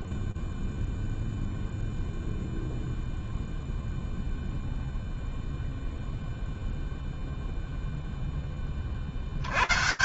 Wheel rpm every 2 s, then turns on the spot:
0, 0, 0, 0, 120.
none